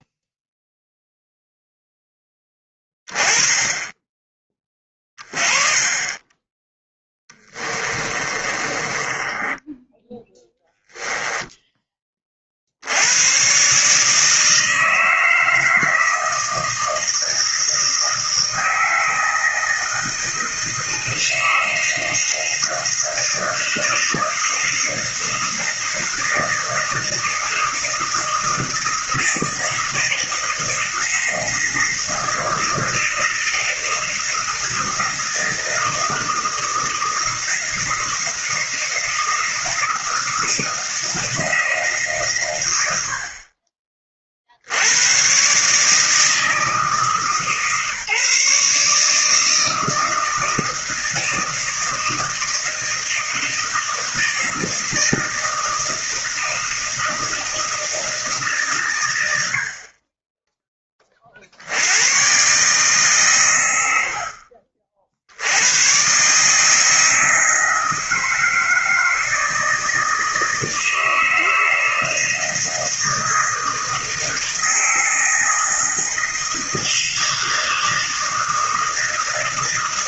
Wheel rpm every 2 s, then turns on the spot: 0, 20, 20, 10, 20, 10, 60, 160, 160, 160, 160, 160, 160, 160, 160, 160, 160, 160, 160, 160, 160, 100, 80, 160, 140, 160, 160, 160, 160, 130, 10, 130, 50, 160, 160, 160, 160, 160, 160, 160.
8-12